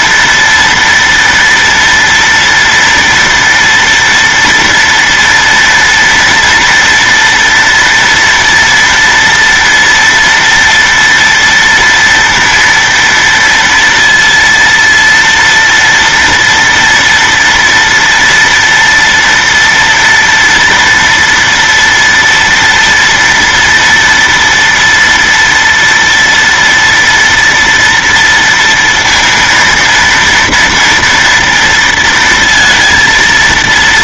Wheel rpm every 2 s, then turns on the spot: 240, 230, 230, 230, 230, 230, 230, 230, 230, 230, 230, 230, 230, 230, 230, 230, 230.
none